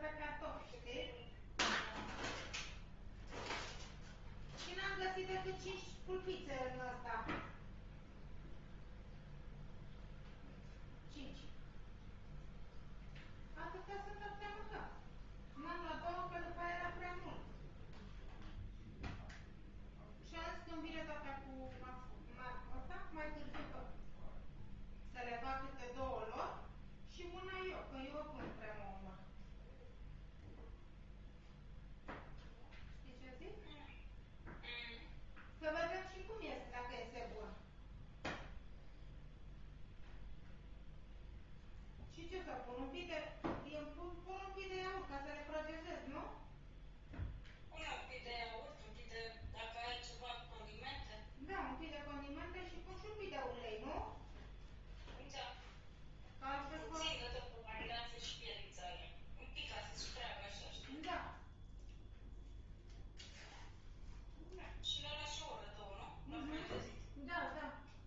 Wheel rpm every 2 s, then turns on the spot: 0, 0, 0, 0, 0, 0, 0, 0, 0, 0, 0, 0, 0, 0, 0, 0, 0, 0, 0, 0, 0, 0, 0, 0, 0, 0, 0, 0, 0, 0, 0, 0, 0, 0.
none